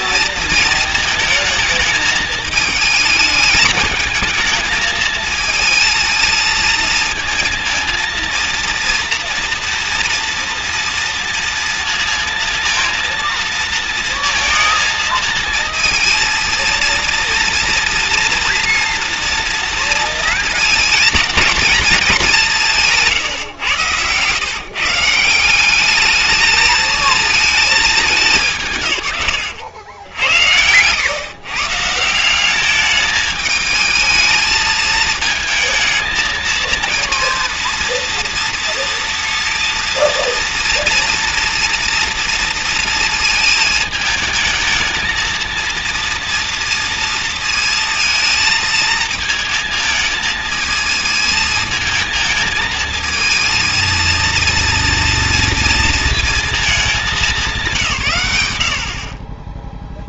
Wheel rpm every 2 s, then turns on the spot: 220, 220, 220, 220, 230, 230, 230, 220, 230, 230, 230, 190, 140, 220, 160, 90, 200, 220, 220, 230, 240, 230, 220, 230, 230, 220, 220, 230, 220, 80.
none